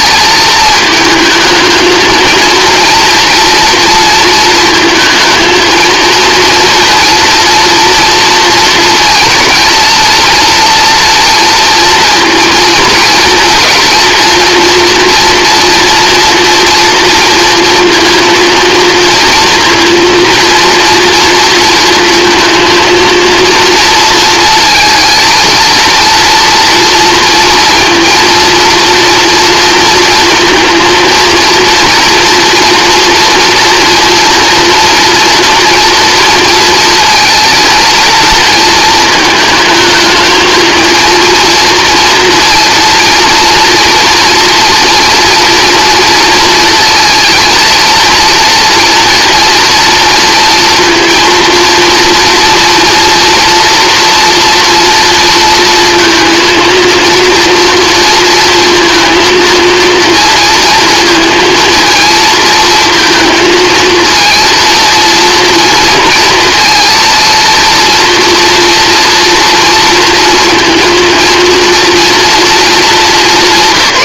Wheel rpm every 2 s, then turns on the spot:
220, 230, 230, 230, 230, 230, 230, 230, 240, 230, 230, 230, 230, 230, 230, 230, 230, 240, 230, 230, 220, 230, 230, 220, 230, 230, 240, 230, 230, 230, 230, 230, 230, 230, 230, 230, 210.
none